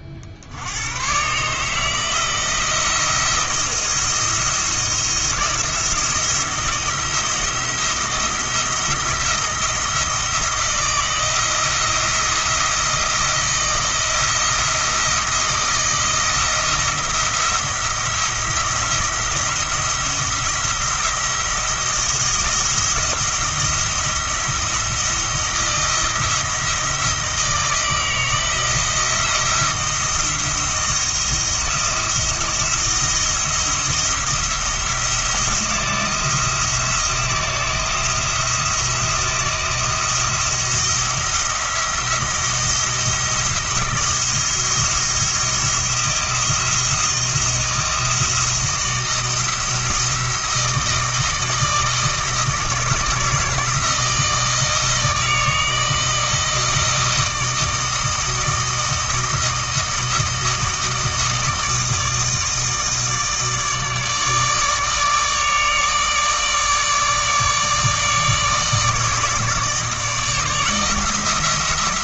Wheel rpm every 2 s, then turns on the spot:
90, 170, 170, 170, 170, 160, 170, 170, 160, 170, 170, 170, 170, 160, 160, 170, 170, 170, 160, 170, 170, 170, 170, 170, 170, 160, 160, 160, 160, 160, 160, 160, 150, 150, 160, 160.
none